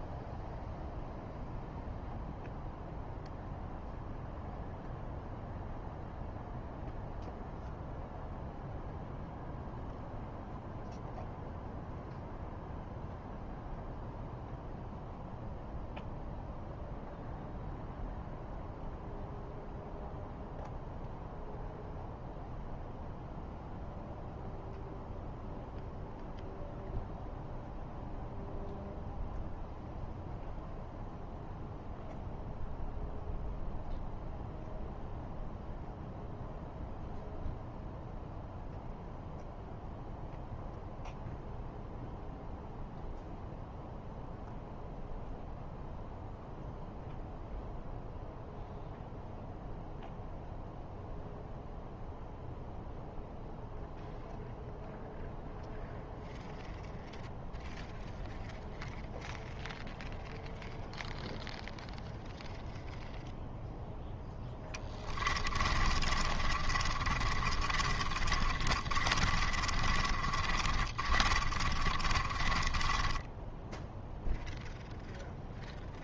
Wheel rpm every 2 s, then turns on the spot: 0, 0, 0, 0, 0, 0, 0, 0, 0, 0, 0, 0, 0, 0, 0, 0, 0, 0, 0, 0, 0, 0, 0, 0, 0, 0, 0, 0, 0, 0, 0, 0, 10, 30, 30, 30, 20, 0.
64-74